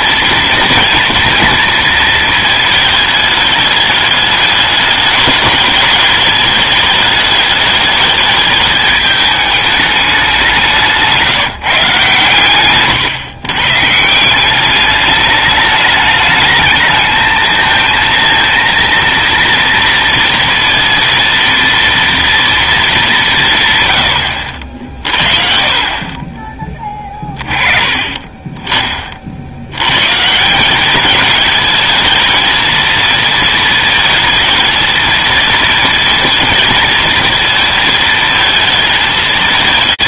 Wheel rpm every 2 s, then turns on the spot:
230, 220, 210, 210, 210, 170, 120, 200, 220, 230, 230, 220, 60, 20, 30, 190, 220, 230, 230, 220.
none